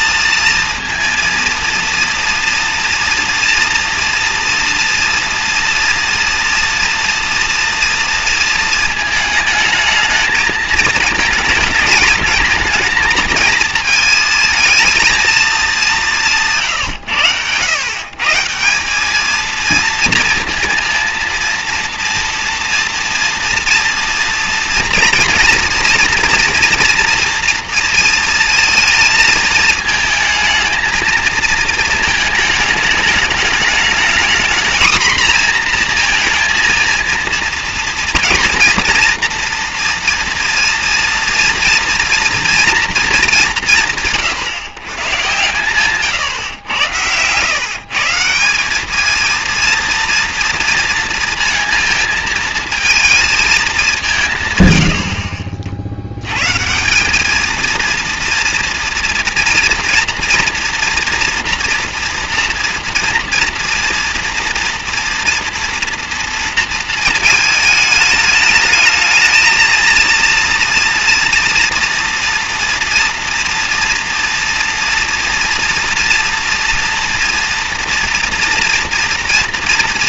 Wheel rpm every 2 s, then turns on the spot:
230, 230, 230, 230, 230, 220, 220, 220, 170, 150, 230, 240, 230, 230, 230, 220, 220, 230, 230, 230, 230, 230, 120, 120, 170, 230, 220, 130, 120, 230, 230, 240, 230, 230, 210, 230, 230, 240, 230, 230.
46-48